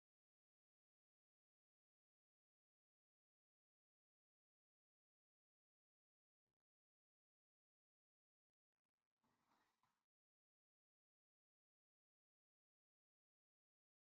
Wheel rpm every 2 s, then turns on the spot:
0, 0, 0, 0, 0, 0, 0.
none